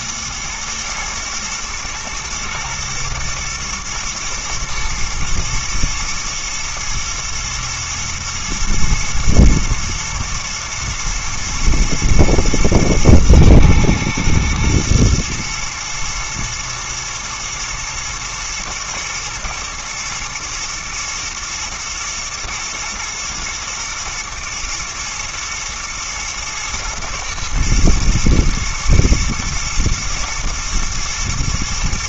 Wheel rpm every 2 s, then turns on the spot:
120, 110, 120, 110, 110, 110, 120, 120, 110, 120, 110, 110, 110, 110, 110, 110.
none